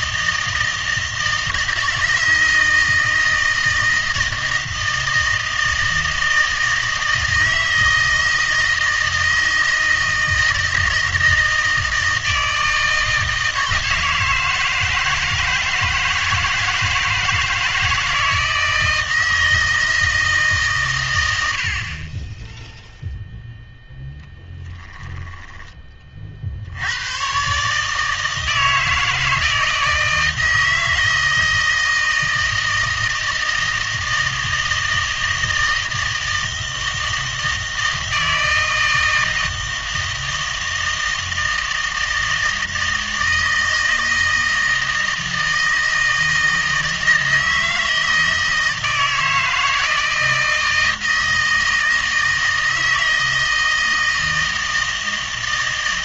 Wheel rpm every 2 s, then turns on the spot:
160, 160, 160, 160, 160, 160, 160, 160, 160, 160, 140, 0, 10, 80, 160, 160, 160, 160, 160, 160, 160, 160, 160, 160, 160, 160, 160, 160.
24-26